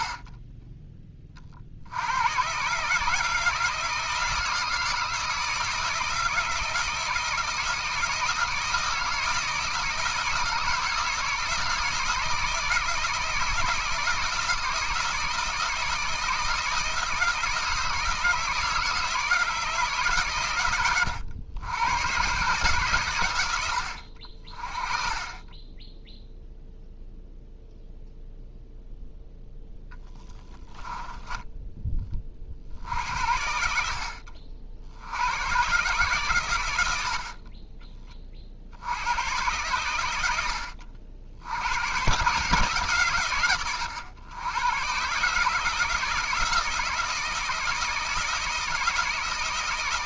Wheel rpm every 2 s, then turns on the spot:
20, 150, 160, 160, 160, 160, 170, 160, 160, 160, 110, 140, 30, 0, 0, 10, 50, 70, 80, 80, 60, 140, 120, 160, 160.
none